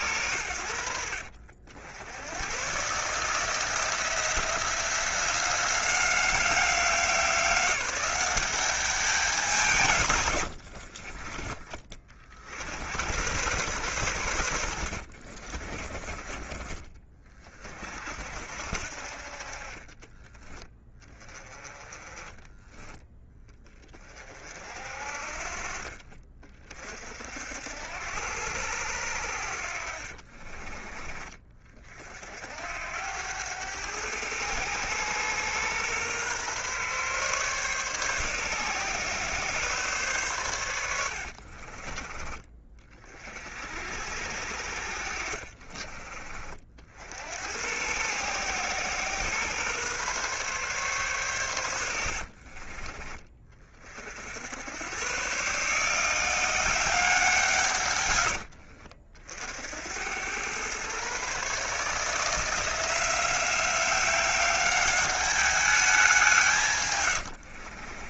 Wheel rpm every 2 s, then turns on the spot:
90, 120, 170, 190, 190, 80, 60, 80, 30, 60, 20, 10, 40, 40, 80, 30, 70, 110, 130, 130, 110, 40, 70, 50, 120, 130, 40, 80, 180, 80, 120, 170, 190, 150.
10-12 14-16 52-54